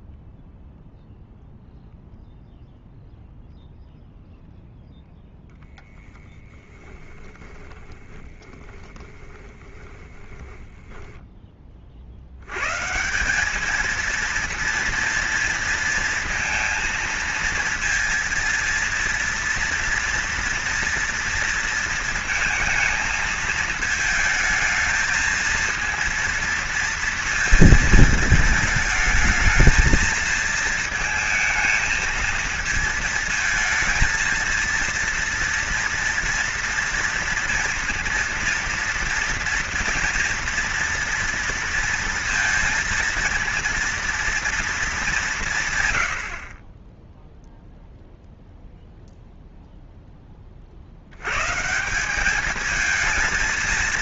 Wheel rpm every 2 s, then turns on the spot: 0, 0, 0, 10, 10, 10, 120, 230, 230, 230, 230, 230, 220, 230, 220, 220, 230, 230, 230, 230, 230, 230, 230, 40, 0, 30, 210.
6-12